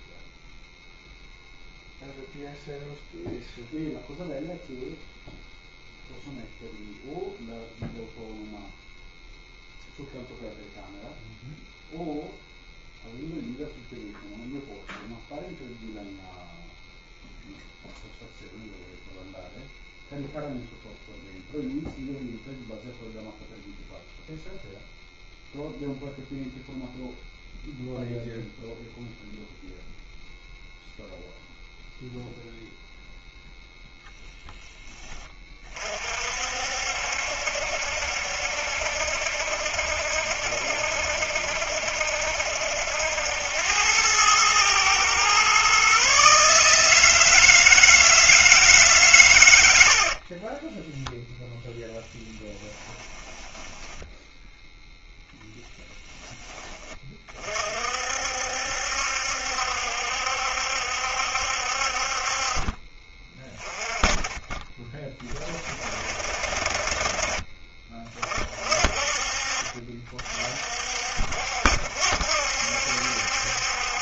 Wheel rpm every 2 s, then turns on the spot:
0, 0, 0, 0, 0, 0, 0, 0, 0, 0, 0, 0, 0, 0, 0, 0, 0, 10, 60, 70, 70, 70, 110, 150, 150, 20, 20, 0, 20, 70, 70, 40, 20, 50, 40, 50, 70.
50-54